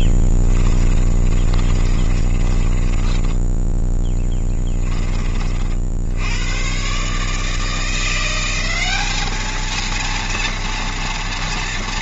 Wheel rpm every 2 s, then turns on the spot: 10, 20, 10, 110, 190, 230.
0-4